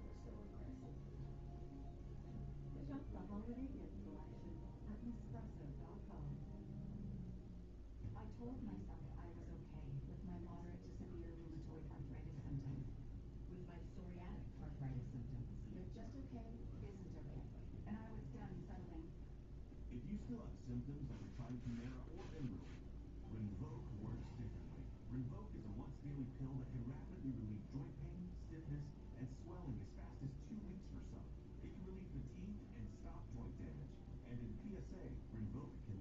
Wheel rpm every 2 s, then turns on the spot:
0, 0, 0, 0, 0, 0, 0, 0, 0, 0, 0, 0, 0, 0, 0, 0, 0, 0.
none